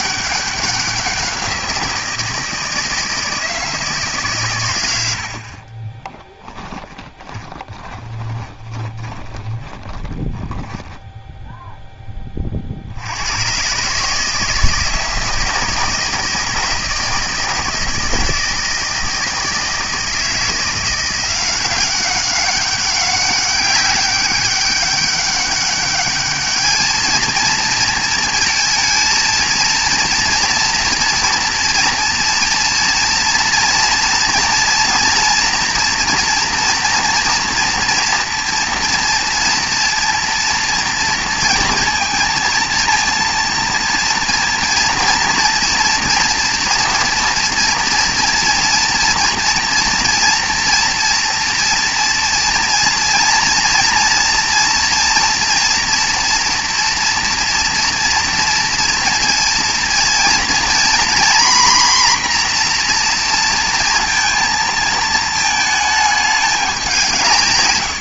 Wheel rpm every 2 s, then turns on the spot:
190, 160, 110, 10, 20, 10, 40, 160, 160, 160, 170, 190, 200, 210, 230, 240, 230, 230, 230, 230, 240, 230, 230, 240, 240, 230, 230, 240, 240, 230, 240, 250, 220, 210.
6-10